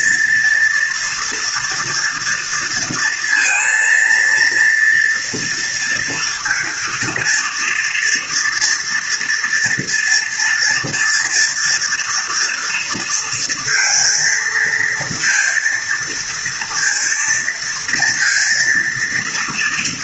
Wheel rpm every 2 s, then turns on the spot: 230, 230, 240, 230, 240, 230, 230, 230, 230, 230.
none